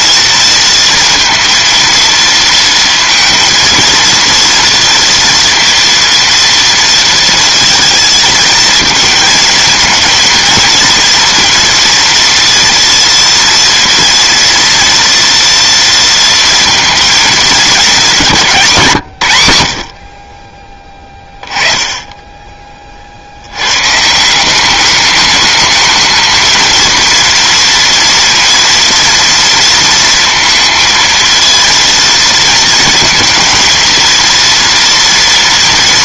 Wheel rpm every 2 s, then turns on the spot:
230, 230, 230, 230, 230, 230, 230, 230, 230, 210, 90, 20, 140, 220, 230, 230, 230, 230.
none